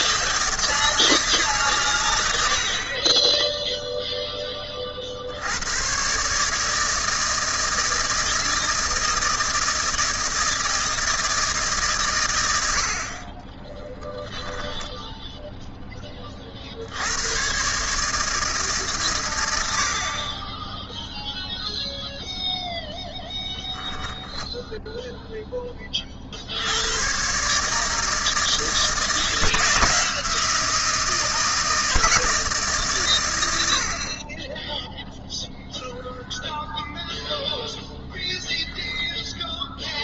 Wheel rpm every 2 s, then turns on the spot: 160, 70, 20, 150, 160, 160, 90, 10, 60, 150, 20, 0, 0, 80, 160, 170, 150, 10, 0, 0.
none